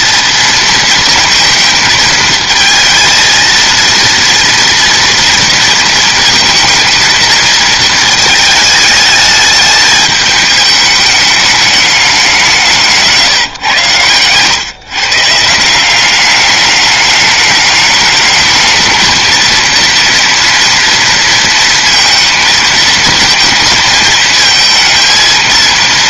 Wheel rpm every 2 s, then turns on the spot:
230, 220, 230, 220, 210, 210, 190, 130, 200, 220, 230, 220, 220.
none